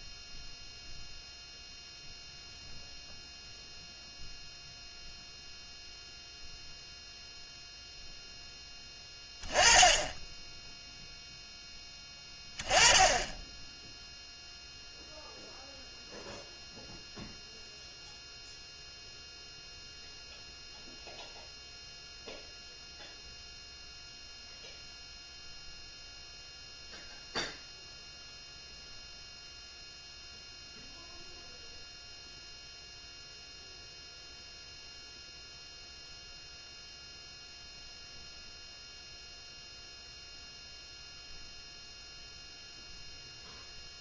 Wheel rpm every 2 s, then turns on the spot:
0, 0, 0, 0, 10, 0, 10, 0, 0, 0, 0, 0, 0, 0, 0, 0, 0, 0, 0, 0, 0, 0.
none